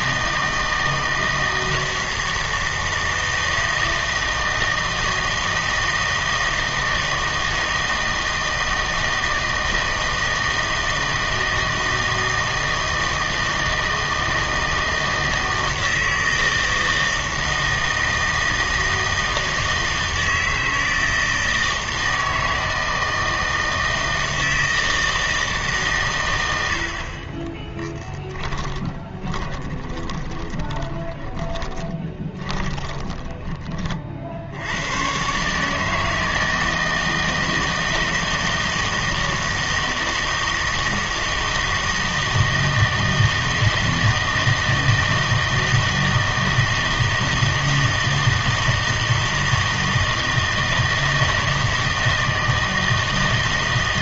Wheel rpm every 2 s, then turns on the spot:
160, 160, 160, 160, 160, 160, 160, 160, 160, 160, 160, 160, 160, 90, 20, 20, 20, 80, 160, 160, 160, 160, 160, 160, 160, 160, 160.
28-34